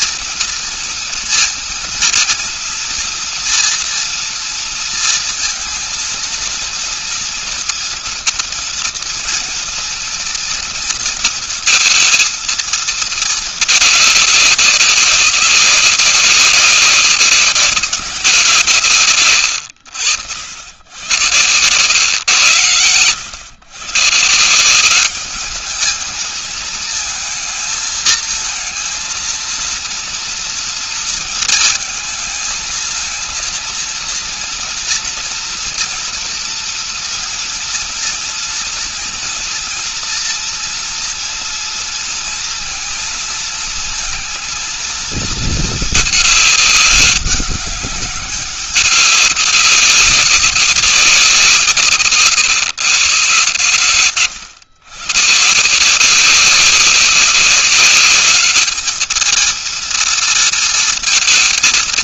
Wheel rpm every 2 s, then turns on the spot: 230, 230, 230, 230, 230, 240, 230, 200, 190, 180, 90, 110, 170, 210, 220, 230, 220, 230, 230, 230, 240, 230, 230, 210, 200, 200, 140, 140, 180, 200, 230.
none